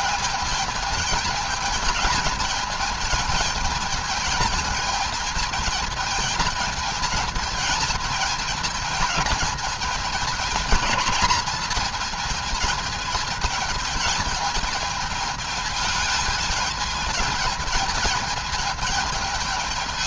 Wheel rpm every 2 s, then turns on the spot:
210, 220, 220, 220, 220, 230, 220, 220, 210, 220.
none